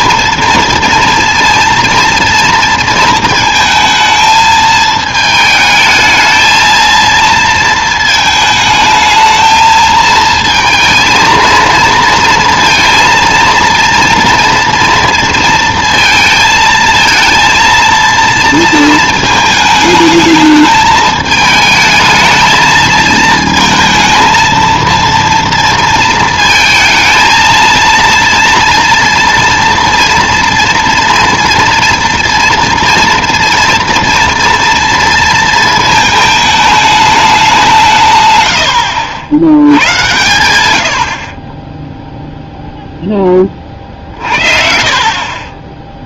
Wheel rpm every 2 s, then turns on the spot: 230, 230, 220, 230, 220, 220, 230, 230, 230, 230, 210, 220, 230, 230, 230, 230, 230, 230, 210, 100, 80, 0, 40.
44-46